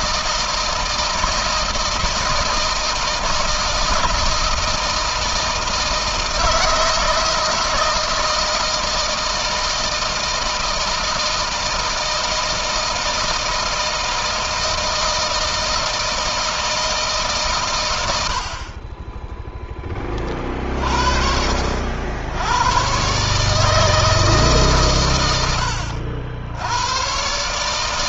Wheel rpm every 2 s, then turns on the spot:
160, 160, 160, 160, 160, 160, 160, 160, 140, 10, 40, 130, 120, 120.
none